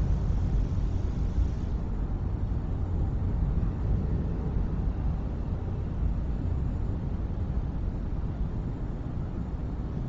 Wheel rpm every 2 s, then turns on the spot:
0, 0, 0, 0, 0.
none